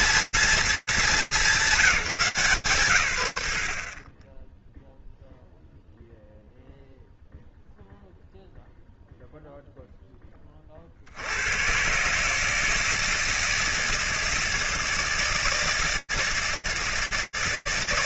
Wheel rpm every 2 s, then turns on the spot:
230, 160, 20, 0, 0, 80, 160, 160, 160.
none